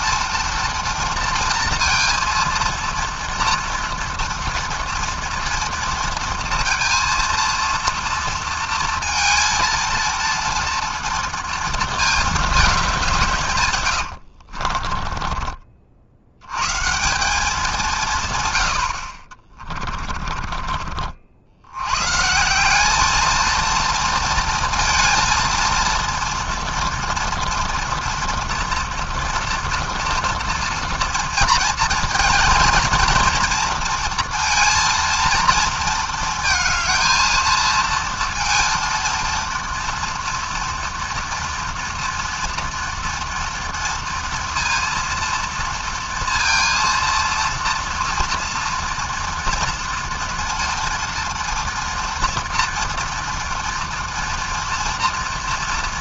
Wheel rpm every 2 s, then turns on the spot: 230, 230, 230, 230, 230, 230, 170, 30, 170, 50, 60, 220, 230, 230, 230, 240, 230, 230, 220, 230, 230, 230, 230, 230, 230, 230, 230, 230.
14-16 18-20